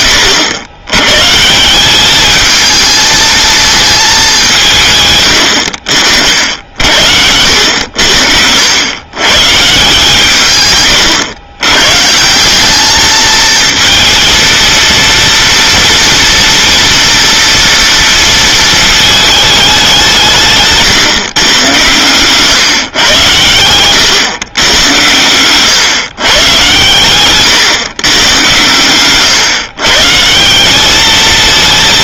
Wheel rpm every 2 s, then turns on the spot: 90, 220, 170, 70, 90, 120, 200, 230, 230, 220, 150, 130, 110, 130, 110, 190.
none